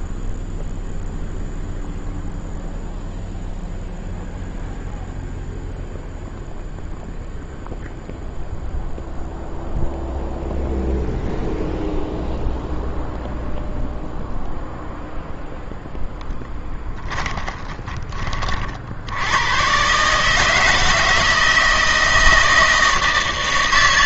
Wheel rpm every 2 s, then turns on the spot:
0, 0, 0, 0, 0, 0, 0, 0, 10, 60, 160, 160.
16-18